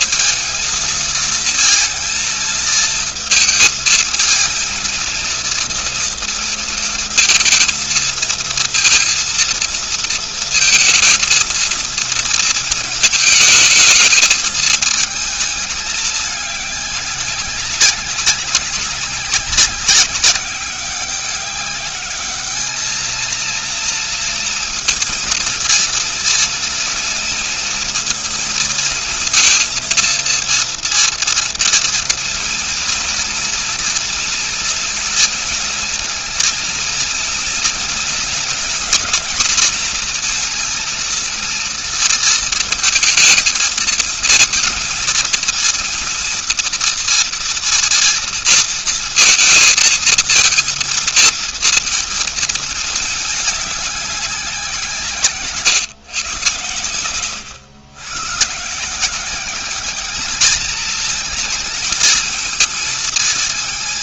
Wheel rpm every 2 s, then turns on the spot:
220, 230, 220, 230, 230, 230, 230, 220, 200, 200, 190, 210, 230, 230, 230, 230, 230, 230, 230, 230, 230, 230, 220, 230, 230, 230, 220, 180, 120, 150, 220, 230.
none